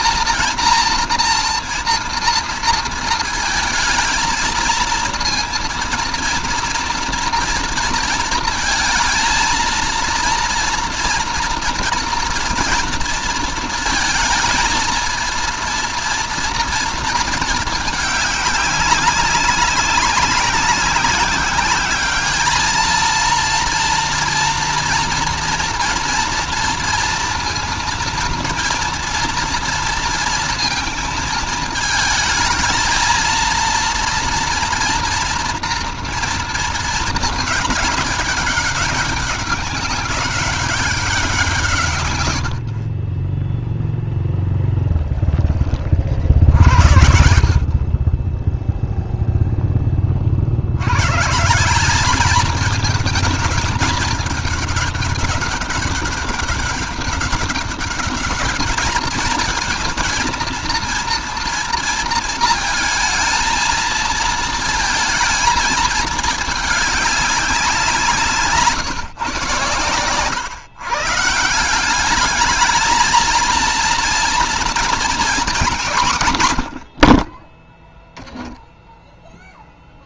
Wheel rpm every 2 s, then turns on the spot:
230, 230, 230, 230, 230, 230, 230, 220, 230, 200, 190, 210, 230, 240, 240, 230, 220, 230, 230, 200, 200, 90, 0, 50, 10, 50, 210, 210, 200, 210, 230, 230, 230, 220, 160, 120, 200, 230, 140, 10.
none